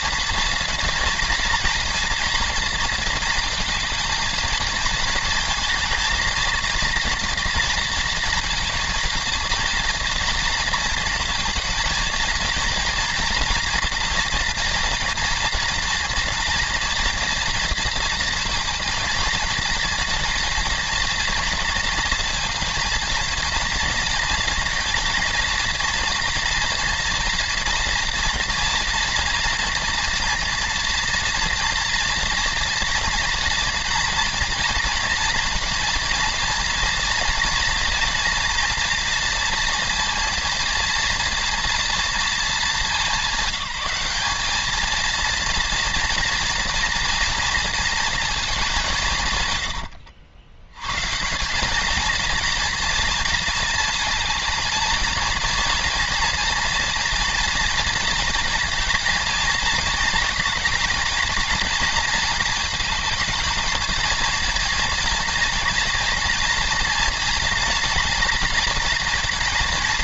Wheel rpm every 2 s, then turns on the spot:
230, 230, 220, 230, 230, 230, 230, 230, 230, 230, 230, 230, 230, 230, 230, 230, 230, 230, 230, 230, 230, 200, 210, 230, 200, 100, 230, 220, 230, 230, 220, 220, 230, 230, 230.
none